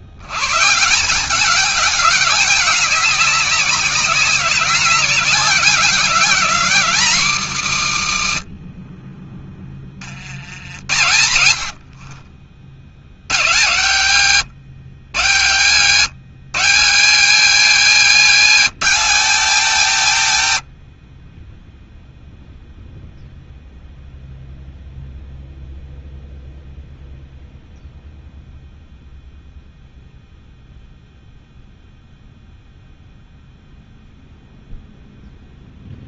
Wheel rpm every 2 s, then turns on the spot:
160, 200, 190, 190, 40, 70, 80, 120, 180, 200, 60, 0, 0, 0, 0, 0, 0, 0.
8-10